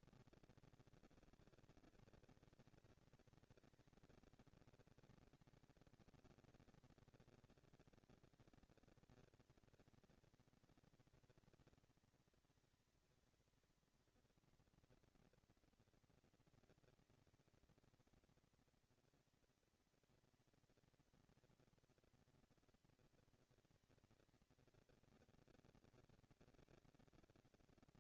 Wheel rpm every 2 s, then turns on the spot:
230, 230, 230, 230, 230, 230, 230, 230, 230, 230, 230, 230, 220, 230.
none